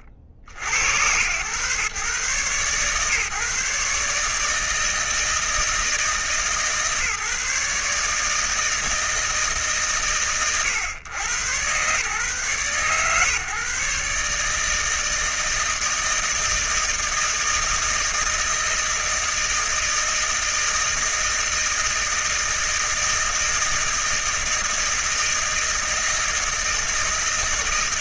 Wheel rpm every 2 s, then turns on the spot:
80, 130, 160, 150, 160, 100, 130, 150, 160, 160, 160, 160, 160, 160.
none